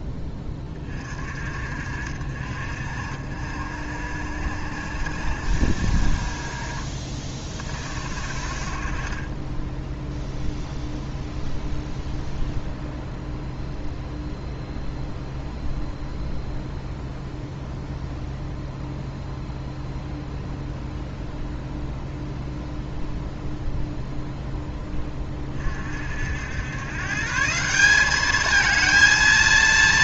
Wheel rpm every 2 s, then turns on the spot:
20, 50, 60, 30, 40, 0, 0, 0, 0, 0, 0, 0, 10, 90, 220.
none